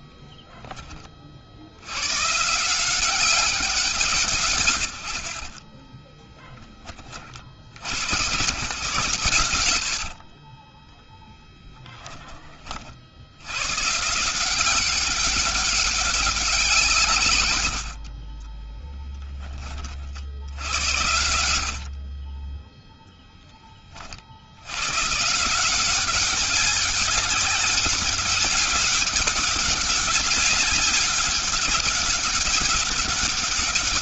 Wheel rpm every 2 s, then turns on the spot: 20, 170, 90, 30, 100, 10, 60, 190, 160, 10, 90, 10, 100, 190, 200, 200, 200.
10-12 18-20